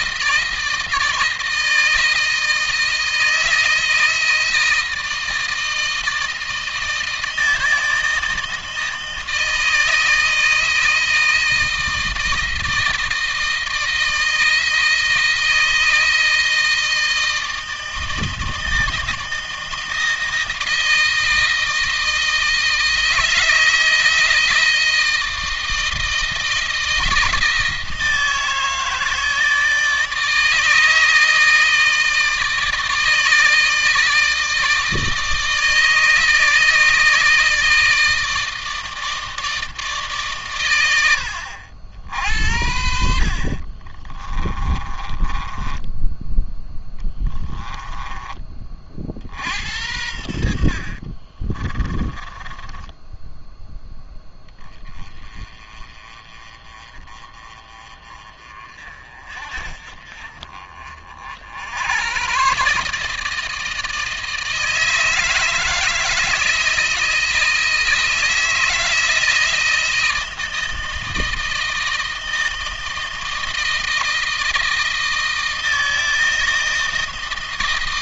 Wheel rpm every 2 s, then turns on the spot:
160, 160, 160, 160, 160, 160, 160, 160, 160, 160, 160, 160, 160, 160, 160, 160, 160, 160, 160, 160, 100, 60, 30, 10, 40, 50, 10, 20, 30, 40, 40, 150, 160, 160, 160, 160, 160, 160, 160.
44-48 50-54